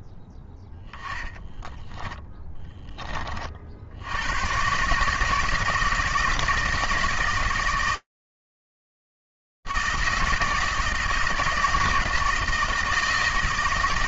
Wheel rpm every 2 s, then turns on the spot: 0, 30, 150, 160, 160, 160, 160.
none